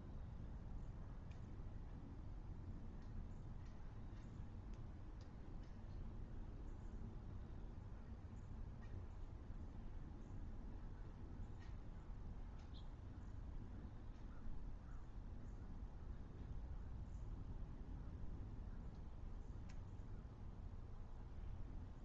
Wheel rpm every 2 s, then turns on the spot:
0, 0, 0, 0, 0, 0, 0, 0, 0, 0, 0.
none